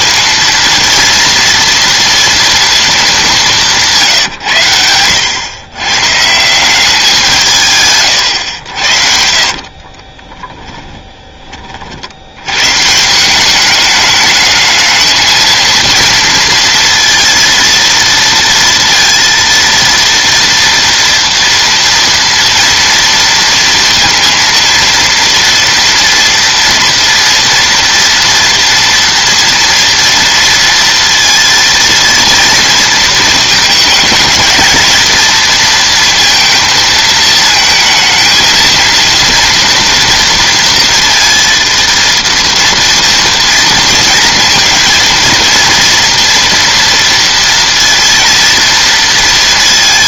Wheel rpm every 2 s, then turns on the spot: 230, 220, 100, 180, 70, 10, 140, 220, 230, 230, 230, 230, 230, 240, 230, 230, 230, 220, 230, 230, 230, 230, 230, 230, 230.
8-12